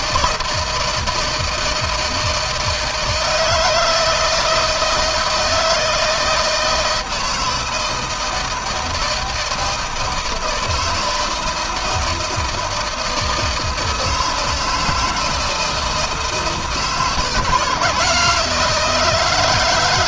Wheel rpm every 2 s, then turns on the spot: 160, 160, 160, 160, 160, 160, 160, 160, 160, 170.
none